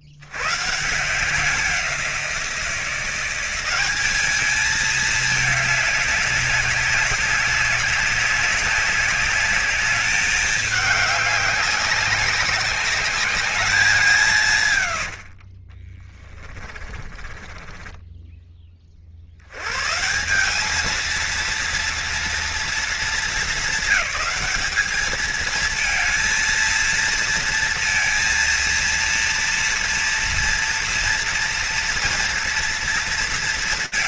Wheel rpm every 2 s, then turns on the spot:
40, 180, 200, 200, 190, 200, 200, 200, 30, 10, 120, 230, 220, 220, 230, 230, 230.
16-20